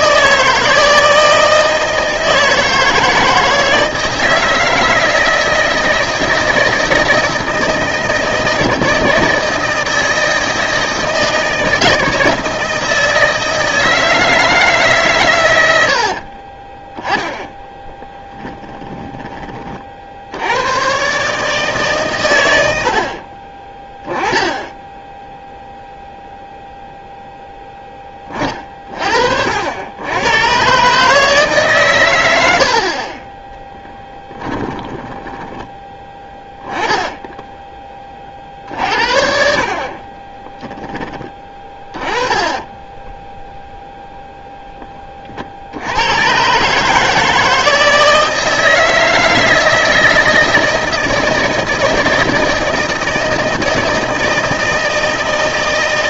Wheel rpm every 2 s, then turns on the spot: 160, 160, 160, 160, 160, 160, 160, 150, 20, 10, 110, 80, 10, 0, 40, 130, 60, 10, 10, 50, 20, 10, 10, 140, 160, 160, 160, 160.
18-20 34-36 42-44